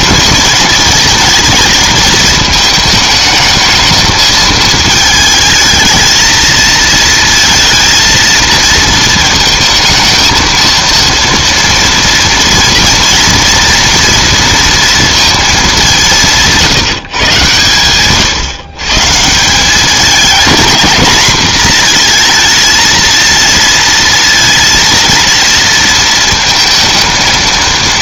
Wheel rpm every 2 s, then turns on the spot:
220, 220, 220, 230, 230, 230, 240, 230, 160, 140, 220, 230, 230, 230.
none